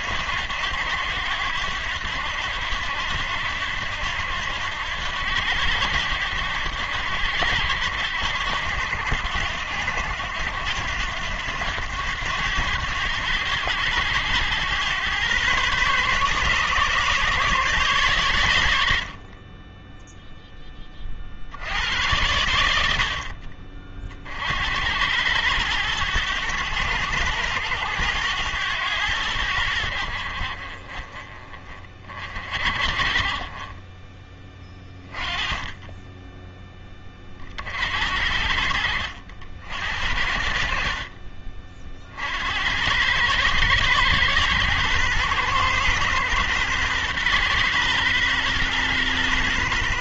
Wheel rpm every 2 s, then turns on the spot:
90, 80, 90, 80, 80, 90, 100, 110, 140, 70, 20, 80, 80, 100, 100, 40, 40, 20, 20, 70, 50, 100, 120, 120, 120.
none